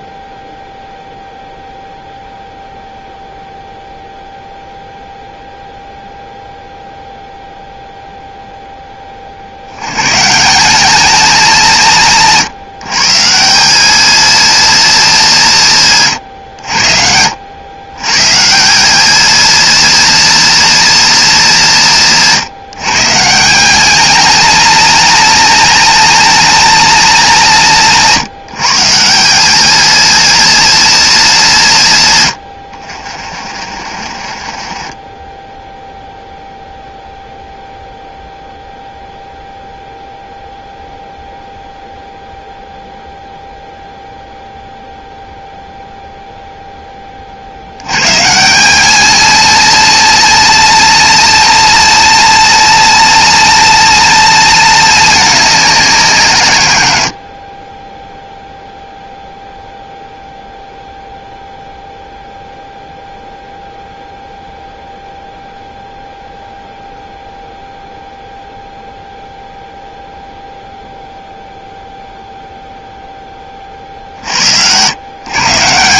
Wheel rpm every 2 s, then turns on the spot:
0, 0, 0, 0, 10, 190, 150, 230, 90, 170, 230, 150, 230, 240, 170, 230, 90, 30, 0, 0, 0, 0, 0, 0, 180, 230, 240, 220, 130, 0, 0, 0, 0, 0, 0, 0, 0, 90.
34-36